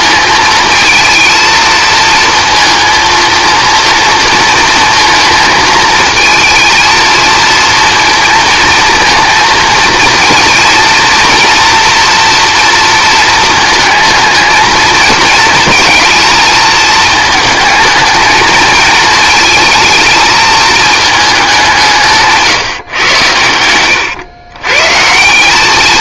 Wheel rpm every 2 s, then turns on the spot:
220, 230, 230, 230, 220, 230, 230, 220, 220, 220, 220, 150, 130.
none